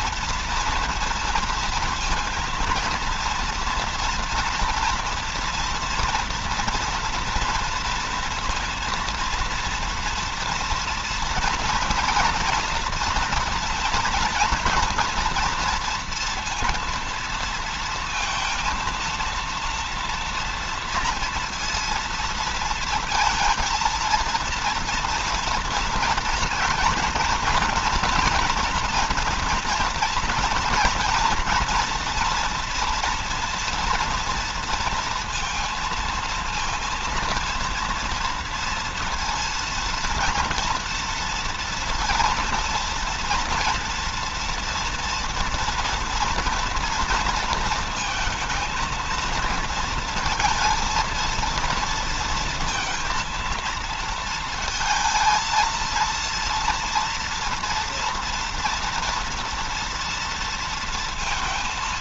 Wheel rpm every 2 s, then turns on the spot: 230, 230, 230, 230, 230, 240, 230, 230, 230, 230, 230, 230, 230, 240, 240, 230, 230, 230, 230, 230, 230, 230, 230, 230, 230, 230, 230, 220, 230, 240, 230.
none